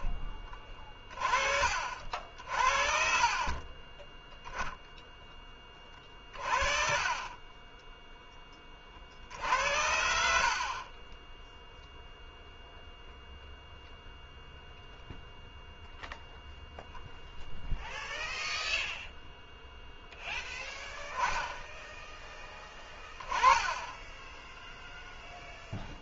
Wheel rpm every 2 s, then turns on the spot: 30, 40, 0, 40, 30, 40, 0, 0, 0, 0, 0, 10, 0.
6-8 22-24